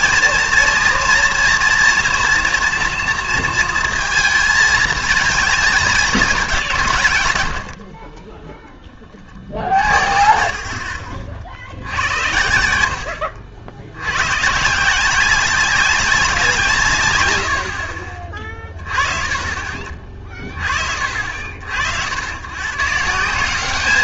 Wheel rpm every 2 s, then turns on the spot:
230, 240, 220, 190, 10, 50, 80, 140, 160, 30, 40, 120.
none